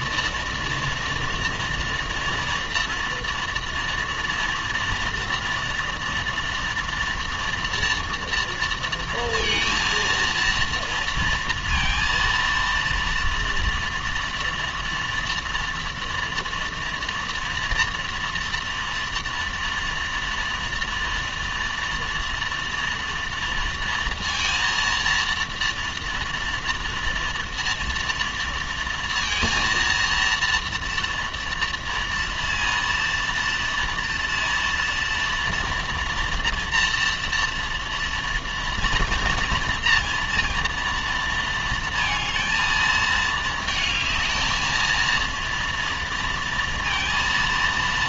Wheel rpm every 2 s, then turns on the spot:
230, 230, 230, 230, 230, 230, 230, 230, 230, 230, 230, 230, 230, 230, 230, 230, 240, 230, 240, 230, 230, 230, 220, 230.
none